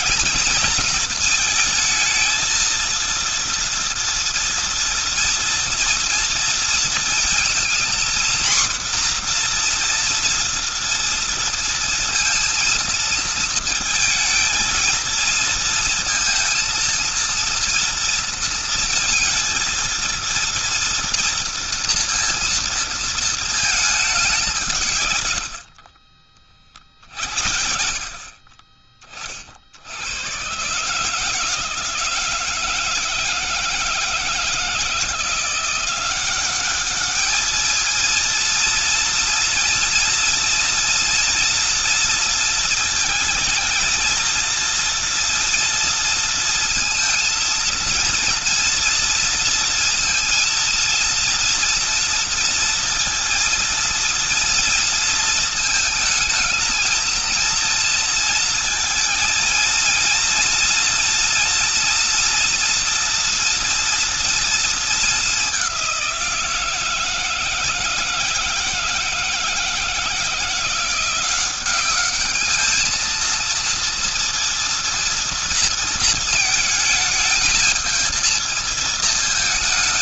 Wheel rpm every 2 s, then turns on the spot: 230, 220, 230, 230, 240, 230, 230, 220, 230, 230, 230, 230, 180, 50, 50, 120, 160, 160, 190, 230, 230, 230, 230, 230, 230, 230, 230, 230, 220, 230, 230, 240, 230, 170, 160, 170, 210, 230, 220, 220.
none